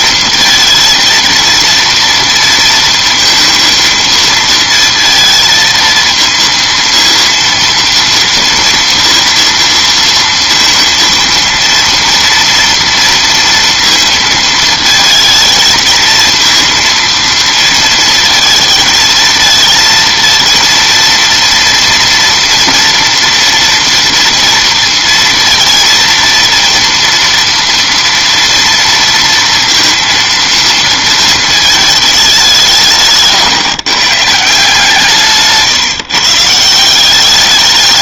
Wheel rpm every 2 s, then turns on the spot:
220, 230, 230, 230, 230, 230, 230, 230, 230, 230, 230, 230, 230, 230, 230, 230, 170, 150, 170.
none